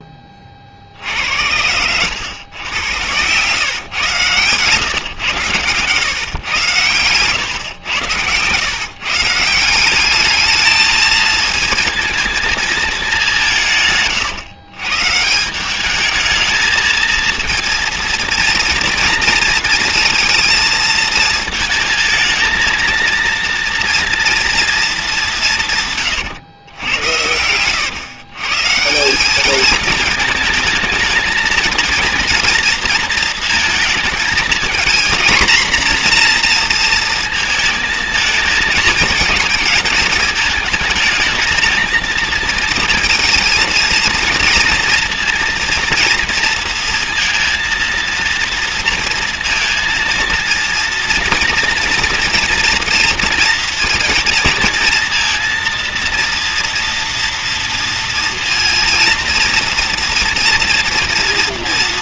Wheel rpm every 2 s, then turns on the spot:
50, 120, 120, 120, 130, 220, 220, 130, 220, 230, 230, 230, 230, 110, 140, 220, 230, 220, 230, 220, 220, 230, 230, 230, 230, 230, 230, 230, 230, 230, 240.
none